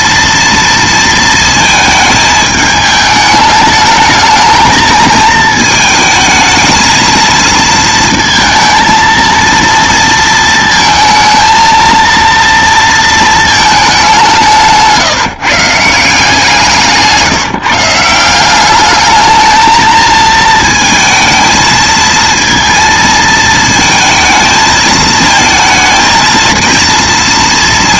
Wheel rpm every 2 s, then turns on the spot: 230, 210, 220, 220, 230, 230, 230, 160, 160, 200, 220, 230, 220, 230.
none